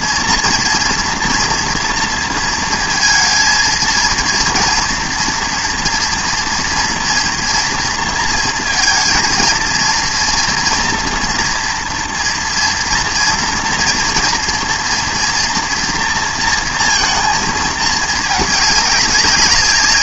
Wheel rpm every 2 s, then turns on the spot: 230, 230, 230, 230, 230, 230, 230, 230, 230, 210.
none